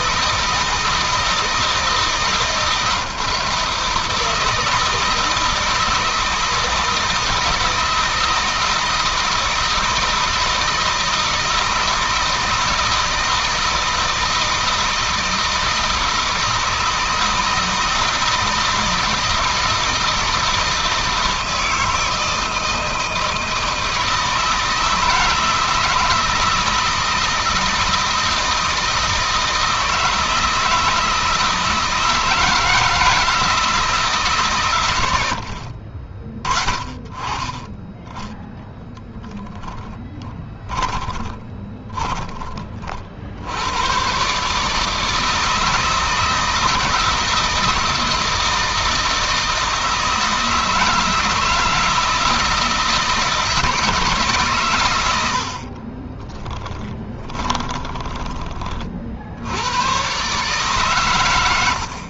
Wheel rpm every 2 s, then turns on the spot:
160, 160, 160, 160, 160, 160, 160, 160, 160, 160, 160, 160, 160, 160, 160, 160, 160, 120, 40, 10, 20, 40, 150, 160, 160, 160, 160, 120, 10, 50, 130.
40-42 56-58